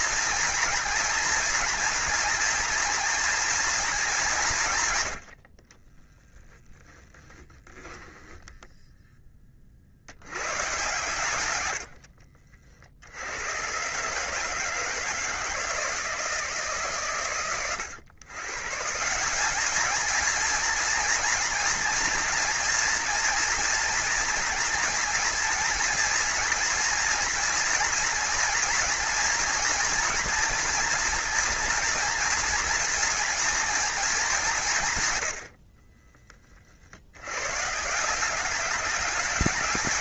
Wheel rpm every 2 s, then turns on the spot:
230, 230, 130, 20, 10, 110, 60, 160, 150, 150, 230, 230, 230, 240, 230, 240, 240, 140, 60, 200.
6-8